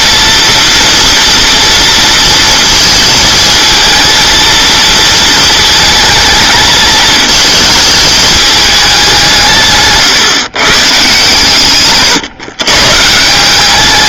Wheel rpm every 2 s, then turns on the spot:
230, 230, 230, 220, 210, 130, 140.
none